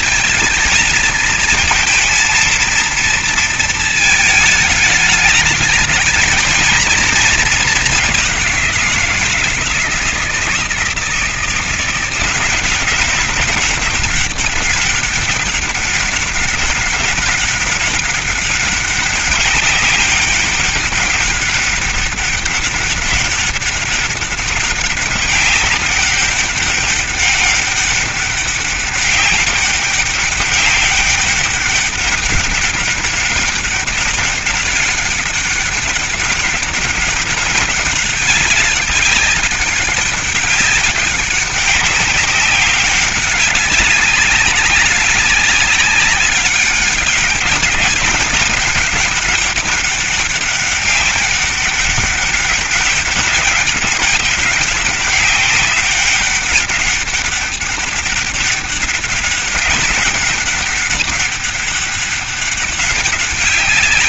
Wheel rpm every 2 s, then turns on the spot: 230, 230, 220, 230, 180, 160, 190, 200, 190, 200, 200, 200, 190, 200, 200, 200, 200, 200, 200, 200, 190, 190, 190, 190, 200, 200, 200, 200, 200, 200, 200, 200.
none